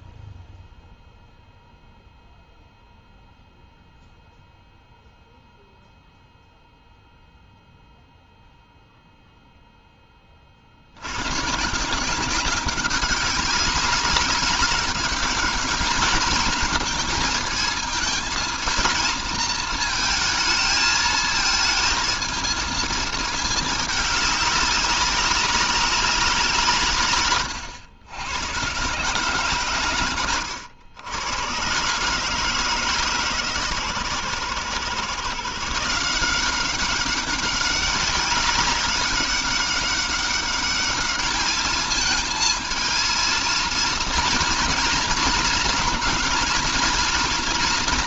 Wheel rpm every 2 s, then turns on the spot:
0, 0, 0, 0, 0, 90, 190, 200, 220, 220, 220, 220, 200, 140, 130, 110, 150, 140, 190, 200, 210, 220, 220, 230.
none